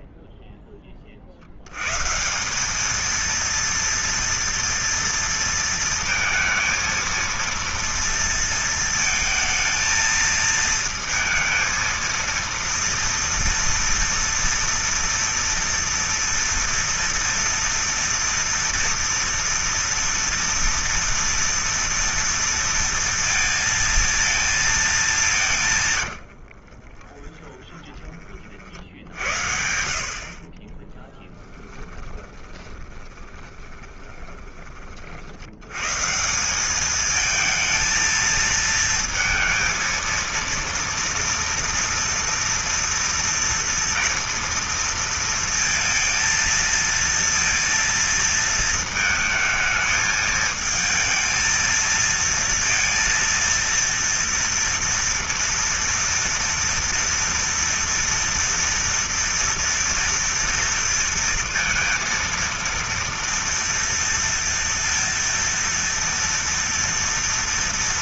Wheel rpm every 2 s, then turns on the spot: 0, 180, 230, 230, 230, 230, 230, 230, 230, 230, 230, 230, 230, 70, 40, 50, 20, 20, 180, 230, 230, 230, 230, 230, 230, 220, 230, 230, 230, 230, 230, 230, 230, 230.
26-28 30-36